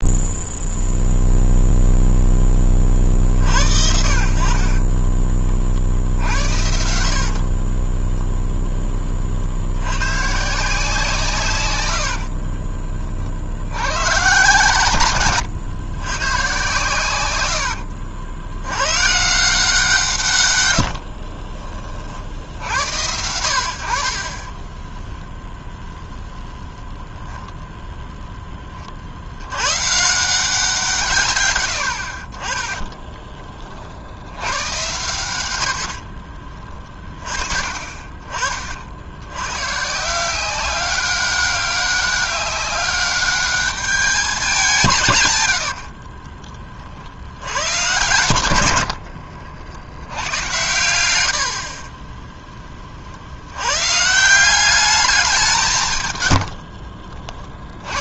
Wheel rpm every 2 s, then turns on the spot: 0, 30, 40, 80, 10, 160, 30, 140, 120, 90, 100, 80, 20, 0, 30, 170, 20, 110, 40, 50, 190, 200, 170, 40, 90, 100, 30, 190, 50.
4-8 12-14 20-22 24-26 32-34 36-38 56-58